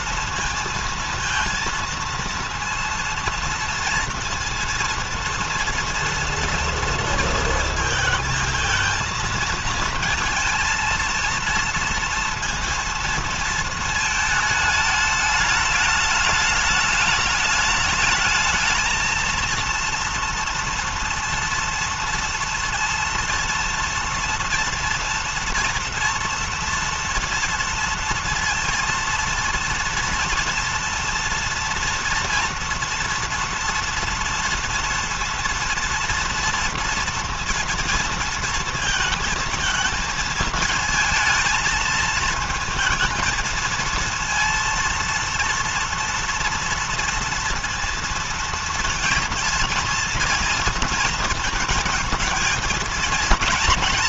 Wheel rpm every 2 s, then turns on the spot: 230, 230, 230, 230, 220, 230, 230, 210, 210, 220, 230, 230, 230, 230, 230, 230, 230, 230, 230, 220, 230, 220, 230, 230, 230, 230, 230.
none